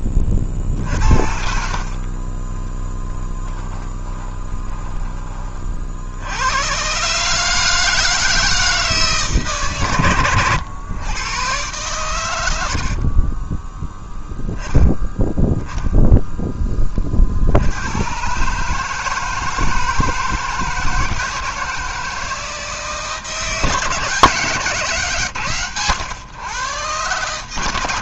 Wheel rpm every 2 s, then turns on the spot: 40, 30, 20, 100, 160, 100, 90, 10, 10, 140, 160, 160, 150, 120.
2-6